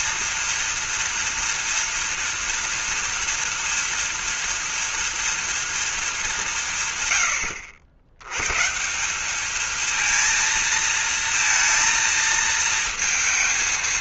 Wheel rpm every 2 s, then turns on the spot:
240, 240, 230, 160, 150, 230, 230.
none